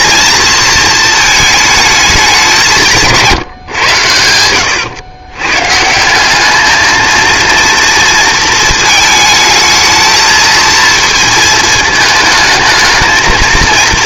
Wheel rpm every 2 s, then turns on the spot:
220, 180, 90, 210, 230, 230, 220.
none